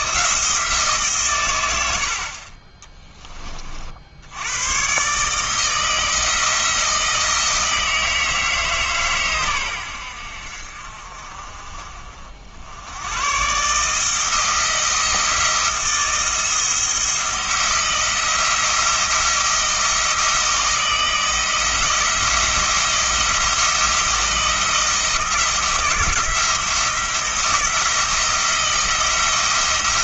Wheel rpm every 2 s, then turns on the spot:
150, 20, 130, 160, 140, 50, 100, 160, 170, 170, 160, 170, 160, 170, 170.
none